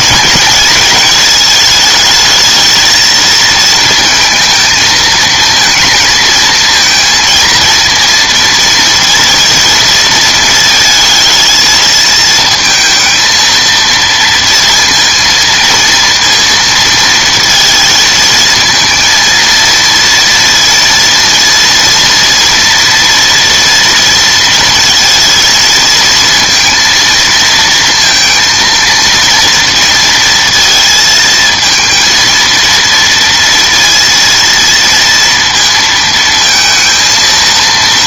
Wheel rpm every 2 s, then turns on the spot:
220, 220, 230, 230, 230, 220, 220, 230, 230, 230, 230, 230, 230, 230, 230, 230, 230, 230, 230.
none